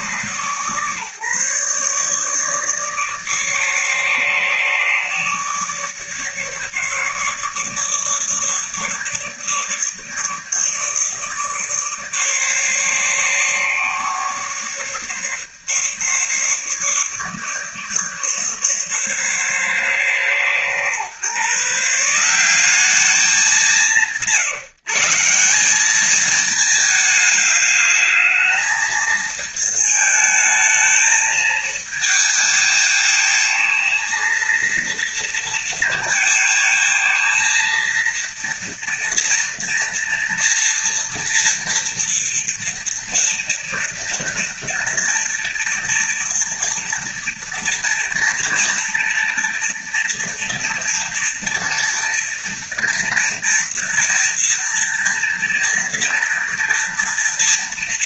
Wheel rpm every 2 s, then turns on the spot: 140, 150, 150, 150, 150, 150, 150, 140, 150, 140, 130, 200, 160, 210, 220, 220, 220, 230, 230, 230, 230, 230, 230, 240, 240, 230, 230, 230, 230.
none